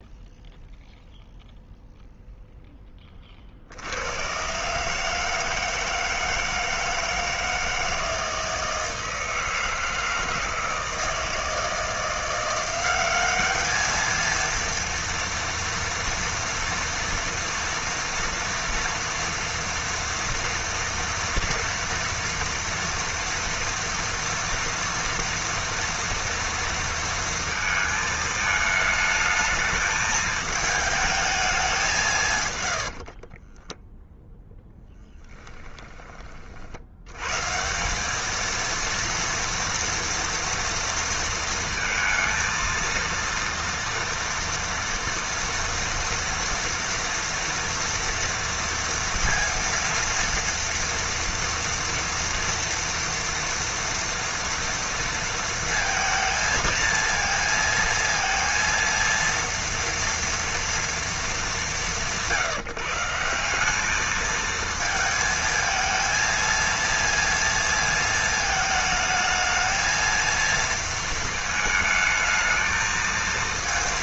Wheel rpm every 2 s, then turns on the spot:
0, 10, 140, 160, 160, 160, 180, 230, 230, 230, 230, 230, 230, 230, 220, 220, 90, 0, 70, 230, 230, 230, 230, 230, 230, 230, 230, 230, 220, 230, 230, 150, 220, 230, 220, 230, 220.
32-34